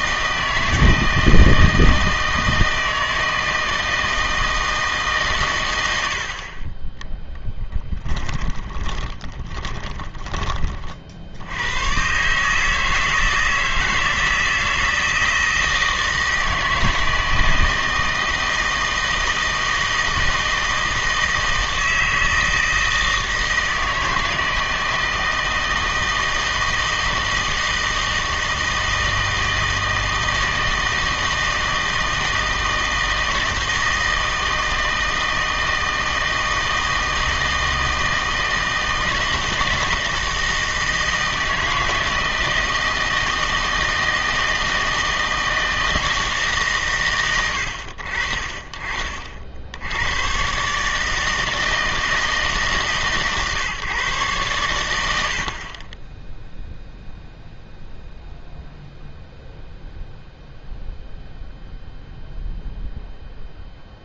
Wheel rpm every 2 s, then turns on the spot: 160, 160, 160, 30, 20, 30, 150, 160, 160, 160, 160, 160, 160, 160, 160, 160, 160, 160, 160, 160, 160, 160, 160, 130, 40, 140, 150, 100, 0, 0, 0, 0.
8-10